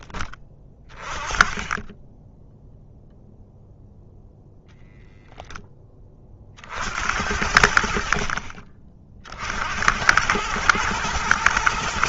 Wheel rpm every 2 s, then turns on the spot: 20, 10, 10, 60, 40, 100.
4-6